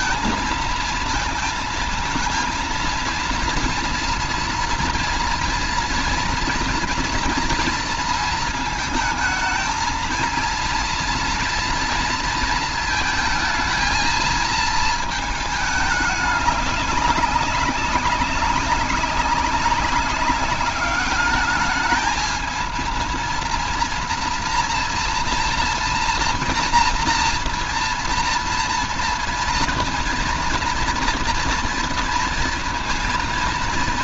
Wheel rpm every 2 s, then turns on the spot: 230, 230, 230, 240, 230, 230, 230, 220, 210, 190, 200, 220, 240, 230, 230, 230, 230.
none